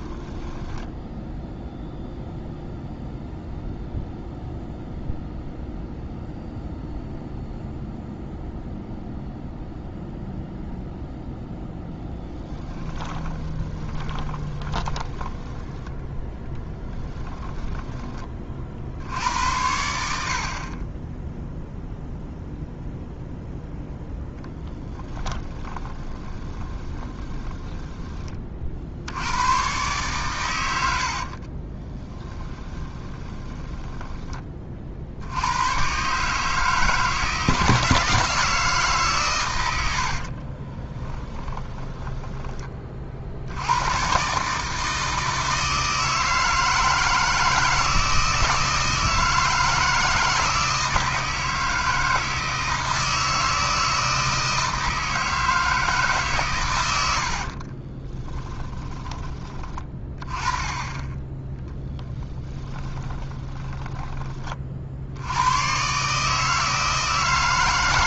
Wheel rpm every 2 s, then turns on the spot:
10, 0, 0, 0, 0, 0, 10, 20, 10, 70, 30, 0, 10, 20, 60, 90, 20, 40, 150, 150, 20, 20, 150, 160, 160, 160, 160, 160, 100, 20, 10, 20, 40, 160.
12-18 24-28 30-34 40-42 58-60 62-64